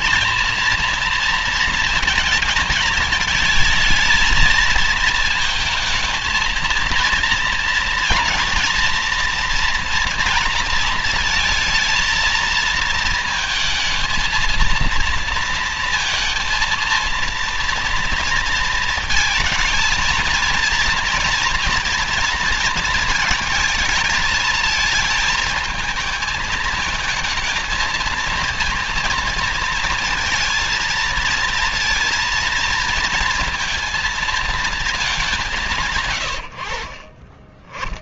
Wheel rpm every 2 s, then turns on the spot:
230, 220, 230, 230, 230, 230, 220, 230, 230, 230, 230, 230, 230, 220, 230, 230, 230, 220, 70.
none